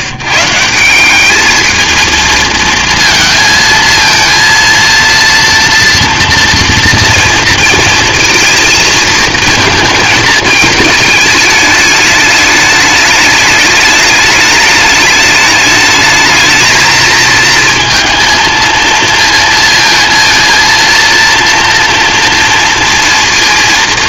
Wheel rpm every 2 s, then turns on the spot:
160, 230, 230, 230, 230, 220, 210, 210, 220, 230, 230, 230.
none